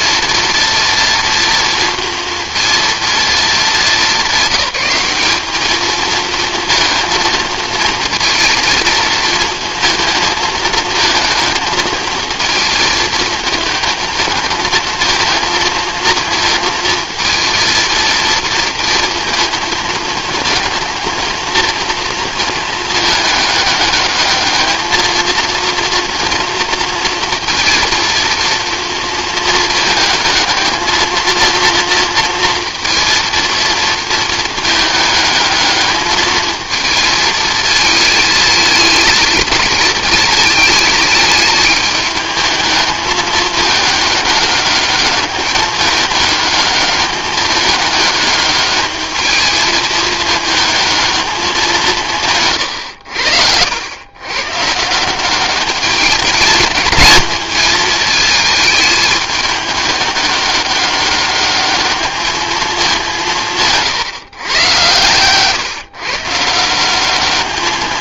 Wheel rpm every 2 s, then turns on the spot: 230, 230, 190, 230, 230, 230, 220, 220, 230, 230, 230, 220, 220, 230, 230, 220, 230, 220, 220, 220, 220, 210, 200, 210, 210, 220, 130, 140, 220, 220, 200, 210, 120, 170.
none